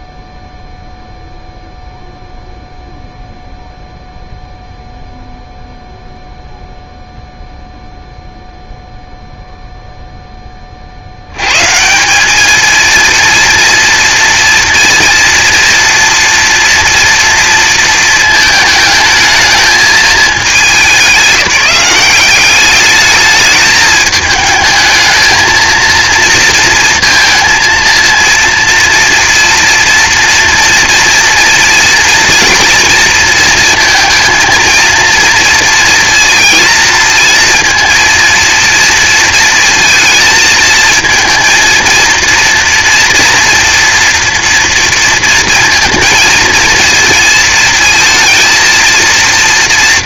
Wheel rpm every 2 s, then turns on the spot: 0, 0, 0, 0, 0, 60, 220, 230, 230, 220, 200, 210, 220, 230, 230, 230, 230, 230, 230, 230, 220, 230, 230, 230, 230.
none